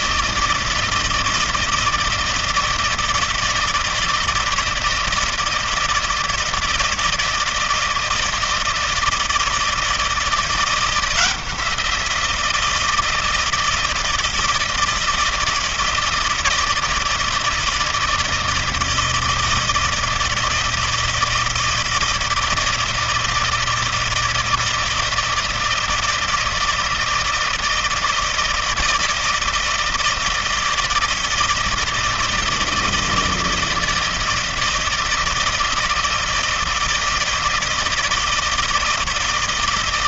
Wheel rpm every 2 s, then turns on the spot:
160, 160, 160, 160, 160, 170, 170, 160, 160, 160, 160, 160, 160, 160, 160, 160, 170, 160, 160, 160.
none